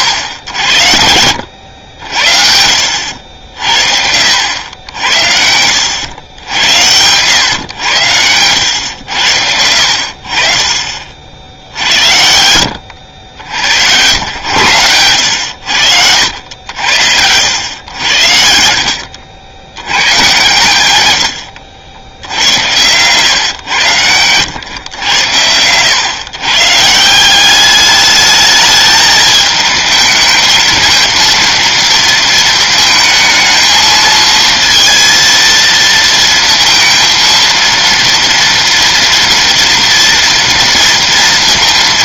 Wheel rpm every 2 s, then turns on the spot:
90, 70, 80, 90, 90, 50, 90, 110, 80, 70, 110, 100, 110, 160, 210, 230, 220, 230, 230, 230, 230.
2-4 10-12 14-16